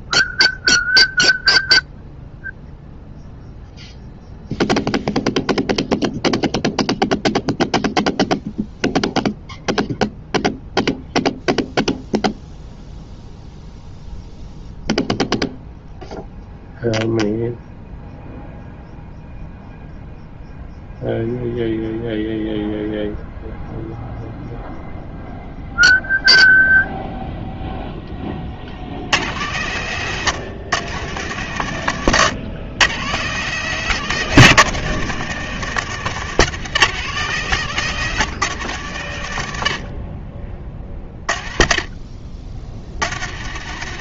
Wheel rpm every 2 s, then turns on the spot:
0, 0, 0, 0, 0, 0, 0, 0, 0, 0, 0, 0, 0, 0, 90, 130, 130, 160, 150, 110, 30, 80.
none